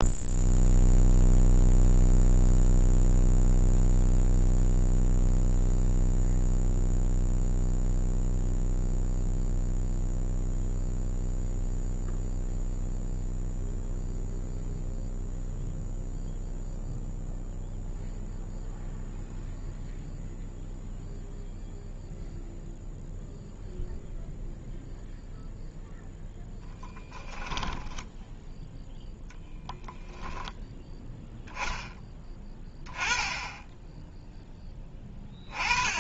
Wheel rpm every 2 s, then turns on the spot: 0, 0, 0, 0, 0, 0, 0, 0, 0, 0, 0, 0, 0, 10, 10, 10, 10, 10.
none